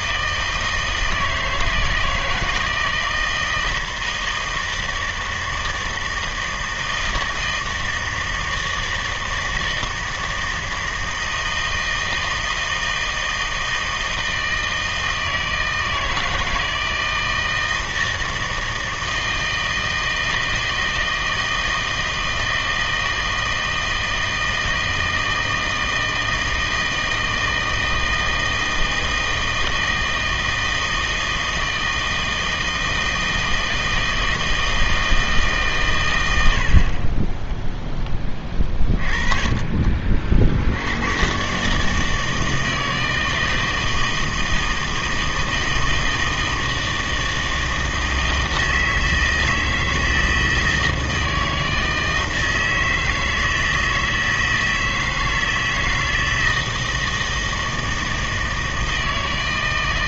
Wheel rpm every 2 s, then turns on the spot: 160, 160, 160, 160, 160, 160, 160, 160, 160, 160, 160, 160, 160, 160, 160, 160, 160, 160, 70, 20, 70, 160, 160, 160, 160, 160, 160, 160, 160, 160.
none